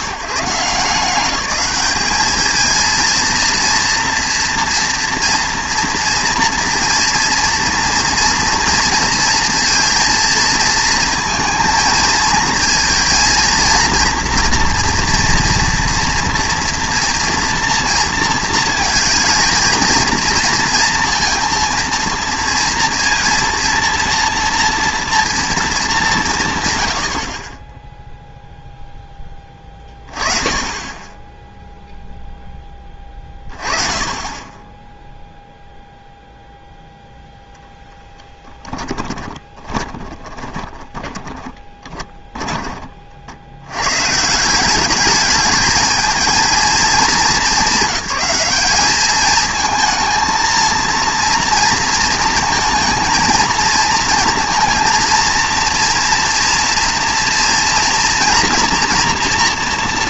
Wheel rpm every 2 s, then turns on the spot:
150, 230, 230, 230, 230, 230, 230, 240, 230, 220, 230, 230, 230, 110, 0, 20, 20, 10, 0, 10, 10, 30, 190, 230, 210, 230, 230, 230, 230, 230.
38-42